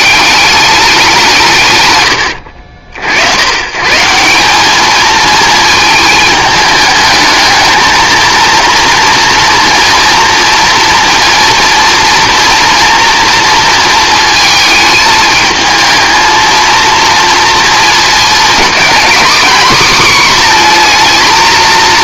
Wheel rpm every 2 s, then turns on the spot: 200, 70, 210, 220, 240, 230, 230, 220, 230, 230, 240.
none